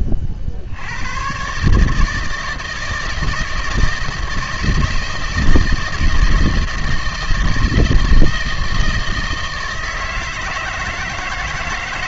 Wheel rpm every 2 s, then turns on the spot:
60, 160, 160, 160, 160, 160.
none